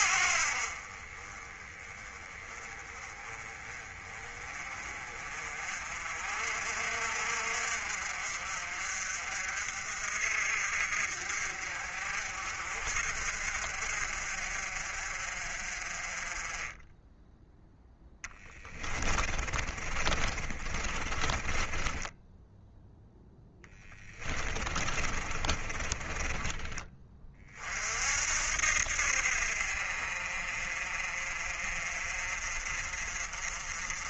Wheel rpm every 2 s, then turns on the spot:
40, 20, 30, 50, 50, 50, 50, 50, 10, 20, 30, 0, 30, 20, 70, 50, 40.
18-22 24-26